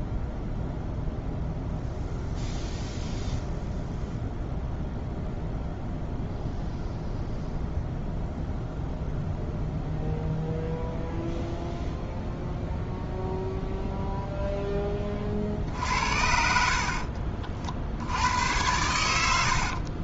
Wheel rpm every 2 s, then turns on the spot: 0, 0, 0, 0, 0, 0, 0, 10, 60, 100.
none